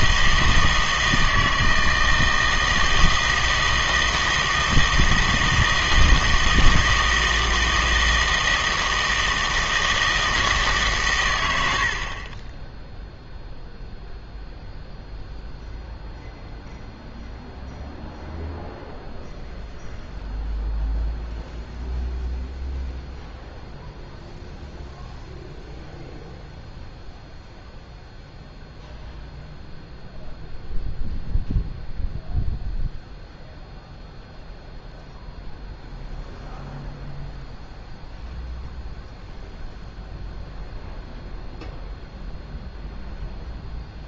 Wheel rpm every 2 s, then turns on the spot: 160, 160, 160, 160, 160, 140, 10, 0, 0, 0, 0, 0, 0, 0, 0, 0, 0, 0, 0, 0, 0, 0.
none